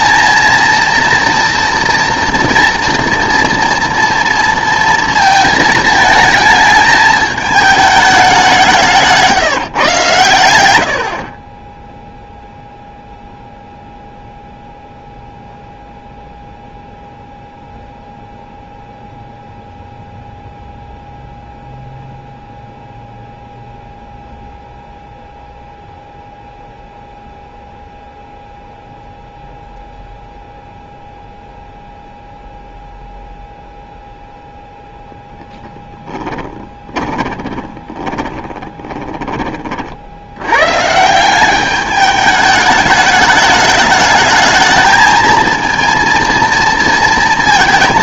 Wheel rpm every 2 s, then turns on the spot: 230, 240, 230, 220, 170, 90, 0, 0, 0, 0, 0, 0, 0, 0, 0, 0, 0, 0, 20, 30, 120, 210, 220, 230.
36-40